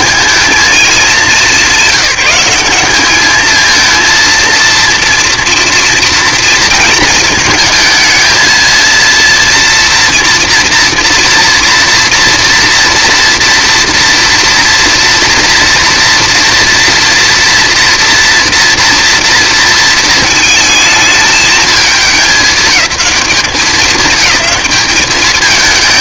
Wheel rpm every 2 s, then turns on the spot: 210, 210, 230, 230, 230, 240, 230, 240, 240, 230, 220, 210, 210.
none